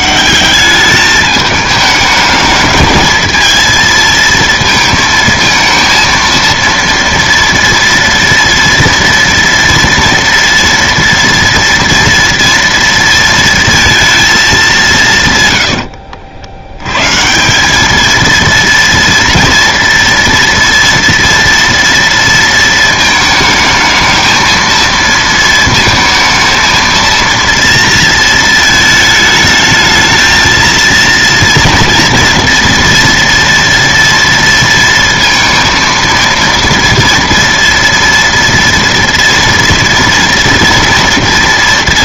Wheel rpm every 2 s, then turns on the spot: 200, 210, 230, 230, 230, 230, 230, 200, 100, 230, 230, 230, 230, 220, 220, 230, 230, 230, 230, 230, 230.
none